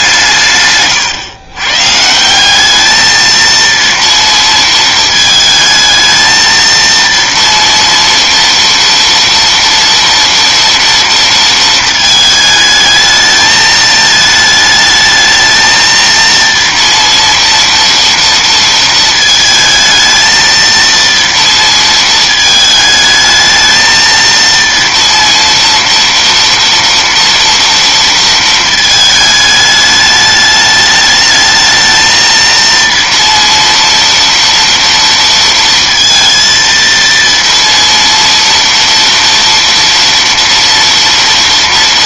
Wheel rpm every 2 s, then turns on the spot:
140, 200, 230, 230, 230, 230, 220, 220, 230, 230, 230, 220, 230, 230, 220, 210, 230, 230, 230, 230, 230.
none